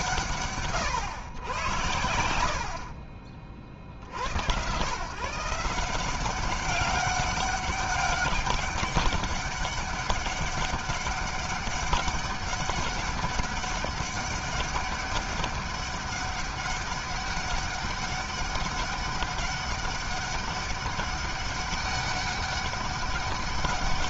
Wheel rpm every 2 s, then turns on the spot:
120, 40, 140, 200, 200, 200, 200, 200, 200, 200, 200, 200.
none